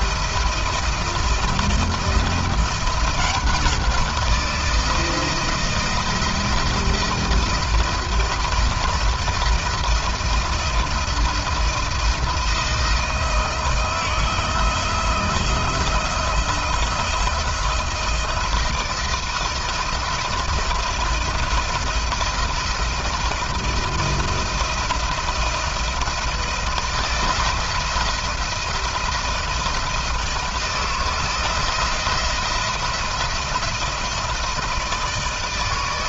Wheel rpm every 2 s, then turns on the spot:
170, 170, 170, 170, 170, 170, 170, 160, 170, 170, 170, 170, 170, 170, 170, 170, 170, 160.
none